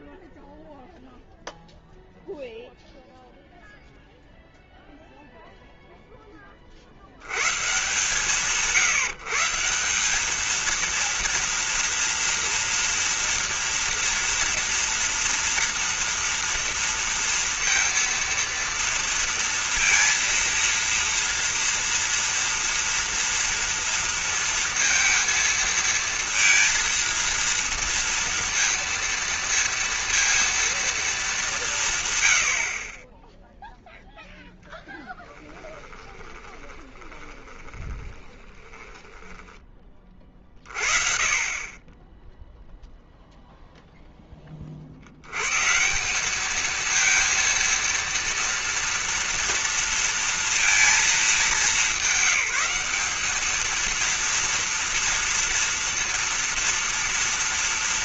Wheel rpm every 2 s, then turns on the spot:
0, 0, 0, 140, 180, 230, 230, 230, 230, 230, 230, 230, 230, 230, 230, 200, 10, 10, 20, 10, 40, 0, 80, 230, 230, 220, 200, 230, 230.
34-40